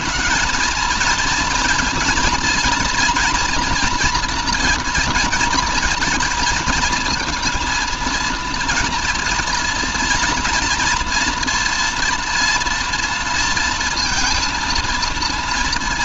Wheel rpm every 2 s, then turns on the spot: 220, 230, 230, 230, 240, 230, 230, 230.
none